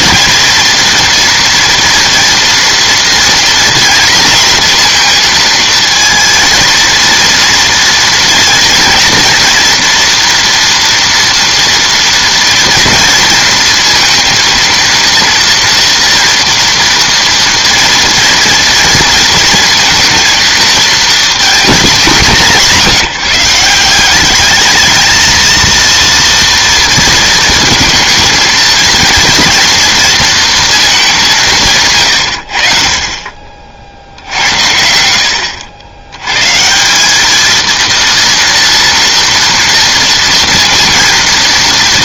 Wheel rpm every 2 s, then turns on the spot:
230, 230, 240, 230, 240, 230, 230, 230, 240, 230, 220, 190, 210, 230, 230, 230, 70, 70, 150, 230, 230.
none